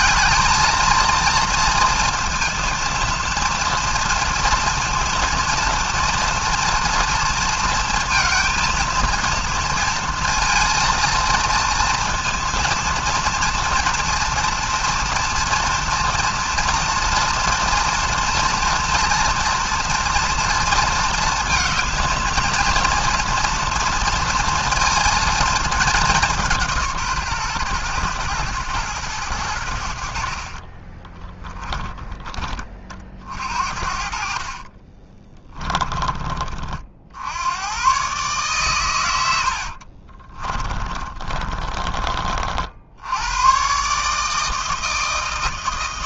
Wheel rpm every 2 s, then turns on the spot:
220, 230, 230, 230, 230, 230, 230, 240, 230, 230, 230, 230, 230, 170, 120, 40, 30, 40, 40, 130, 30, 60, 160.
30-32 34-36 40-42